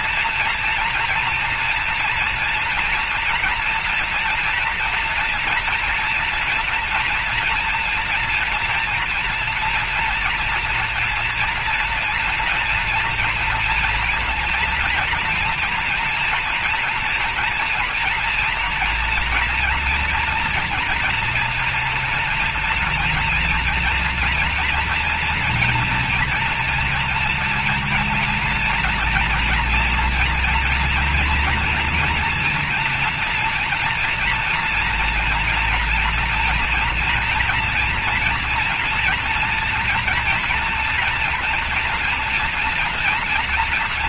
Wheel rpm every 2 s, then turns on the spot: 230, 230, 230, 230, 230, 230, 240, 240, 240, 230, 230, 230, 230, 230, 240, 240, 230, 240, 230, 230, 230, 230.
none